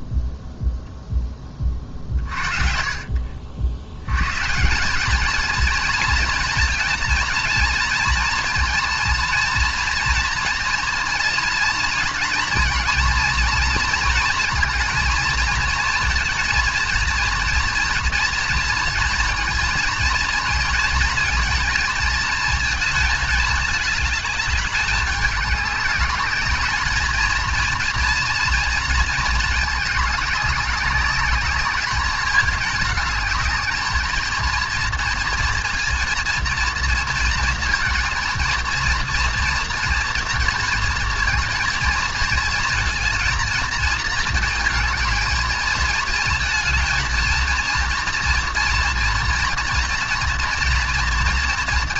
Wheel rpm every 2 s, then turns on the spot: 0, 50, 160, 230, 230, 230, 230, 230, 230, 230, 230, 220, 210, 220, 230, 200, 210, 230, 230, 230, 230, 230, 220, 230, 240, 230.
none